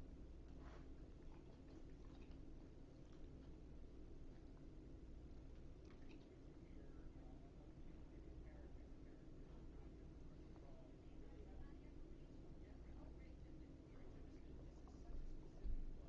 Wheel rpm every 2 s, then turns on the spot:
0, 0, 0, 0, 0, 0, 0, 0.
none